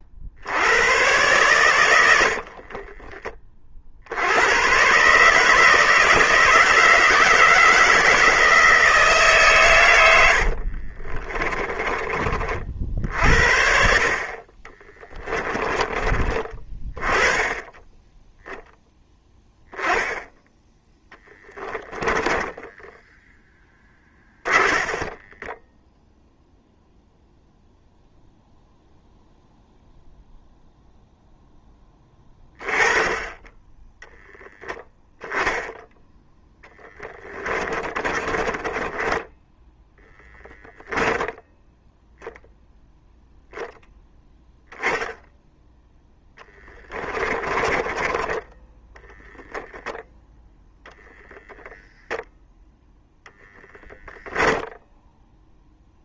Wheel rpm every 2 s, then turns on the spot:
100, 30, 120, 160, 150, 40, 60, 20, 20, 0, 10, 10, 30, 0, 0, 0, 10, 10, 10, 20, 10, 0, 10, 20, 10, 0, 0, 0.
2-4 10-12 14-16 24-26 36-42 46-48